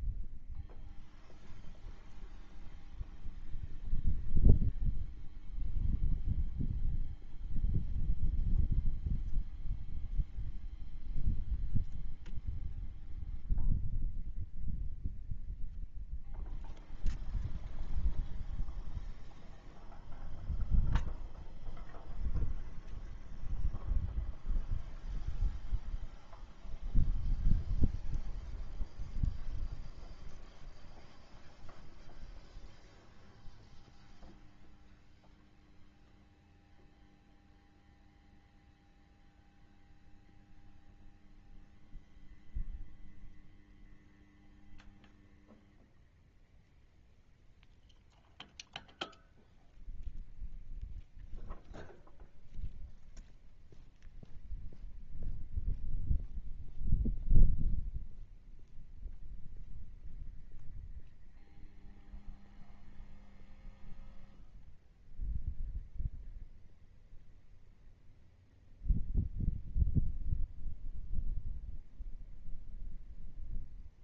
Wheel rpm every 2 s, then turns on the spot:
0, 0, 0, 0, 0, 0, 0, 0, 0, 0, 0, 0, 0, 0, 0, 0, 0, 0, 0, 0, 0, 0, 0, 0, 0, 0, 0, 0, 0, 0, 0, 0, 0, 0, 0, 0, 0.
none